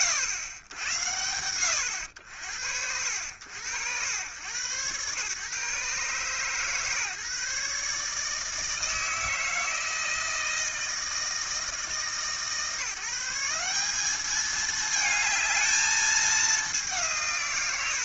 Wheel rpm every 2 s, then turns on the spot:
90, 80, 130, 140, 160, 160, 160, 220, 180.
none